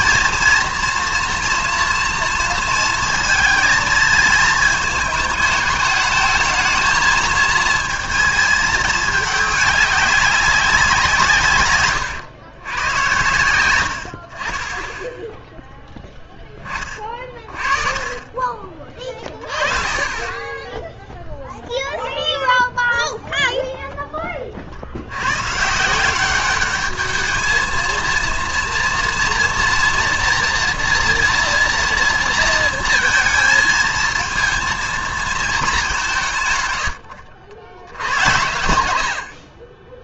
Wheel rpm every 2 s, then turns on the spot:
230, 230, 210, 220, 210, 180, 110, 20, 30, 20, 10, 0, 60, 210, 230, 230, 230, 230, 110, 120.
none